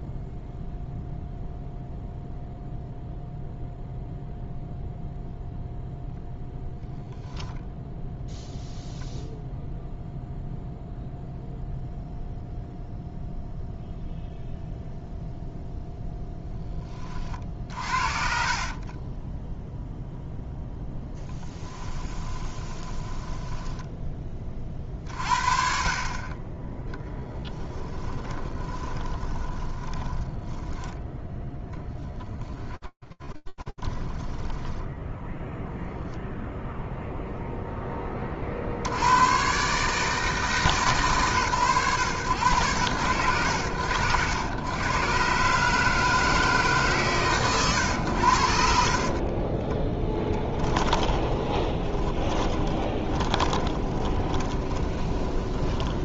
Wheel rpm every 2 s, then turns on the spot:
0, 0, 0, 0, 0, 0, 0, 0, 20, 30, 0, 20, 40, 10, 30, 10, 10, 0, 10, 140, 120, 80, 150, 110, 20, 20, 20, 20.
18-20 22-24 28-30 32-34 48-56